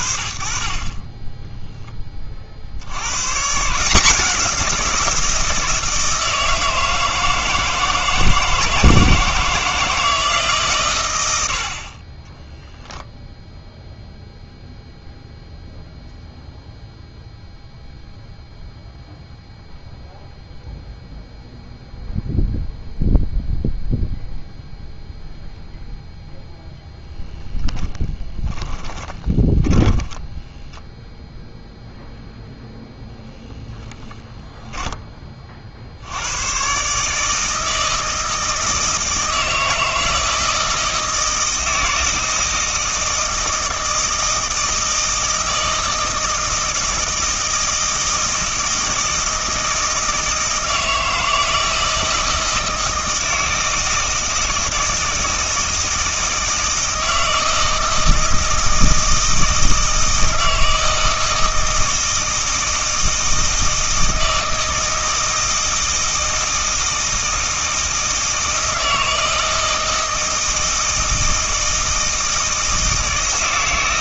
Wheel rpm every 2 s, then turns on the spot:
30, 90, 180, 160, 160, 130, 0, 0, 0, 0, 0, 0, 0, 0, 10, 0, 0, 10, 150, 160, 160, 160, 160, 160, 160, 160, 160, 160, 160, 160, 160, 160, 160, 160, 160, 160, 160.
28-30